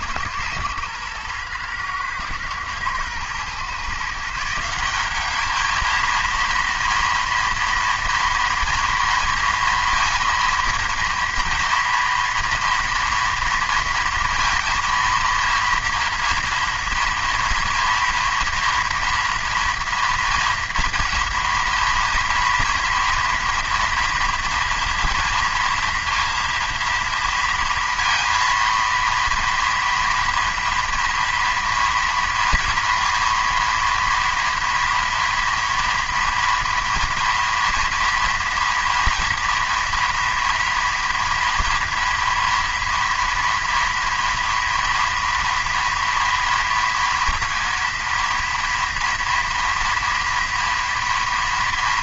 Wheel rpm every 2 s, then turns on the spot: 110, 120, 180, 230, 240, 230, 230, 230, 230, 240, 230, 230, 230, 230, 230, 240, 230, 230, 230, 230, 230, 230, 240, 230, 230, 230.
none